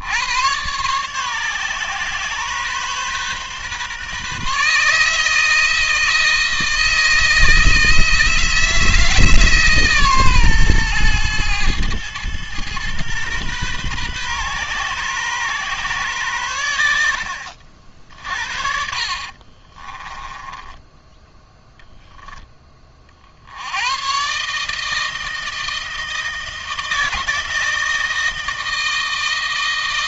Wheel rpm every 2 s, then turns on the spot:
120, 130, 150, 160, 160, 120, 120, 130, 80, 50, 10, 30, 160, 160, 160.
18-22